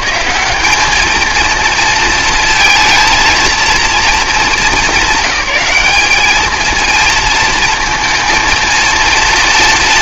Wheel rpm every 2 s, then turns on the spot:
200, 230, 200, 230, 230.
none